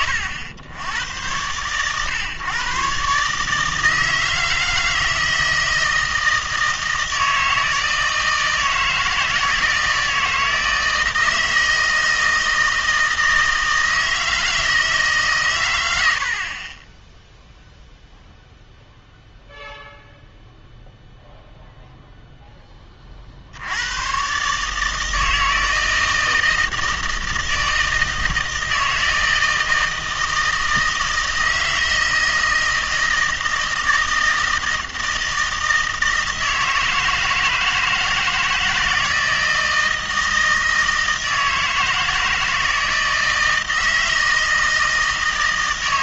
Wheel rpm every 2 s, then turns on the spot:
100, 130, 160, 160, 160, 160, 160, 160, 20, 0, 0, 20, 150, 160, 160, 160, 160, 160, 160, 160, 160, 160, 160.
none